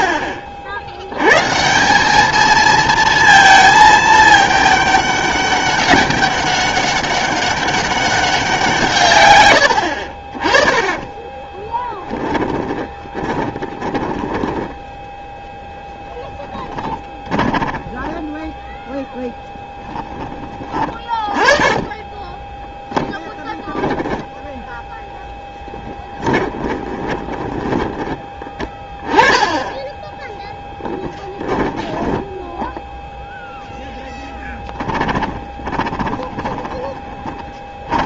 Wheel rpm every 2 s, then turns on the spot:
60, 220, 210, 200, 170, 20, 30, 10, 20, 10, 20, 10, 10, 20, 20, 10, 0, 10, 20.
12-18 24-28 34-38